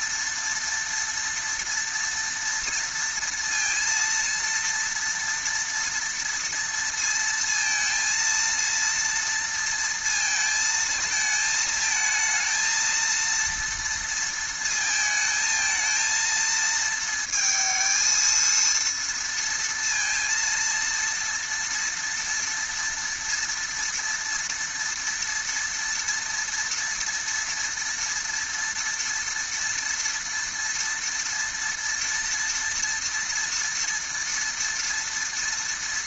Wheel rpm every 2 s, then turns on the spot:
230, 230, 230, 230, 230, 220, 220, 220, 230, 230, 230, 230, 230, 230, 230, 230, 230, 230.
none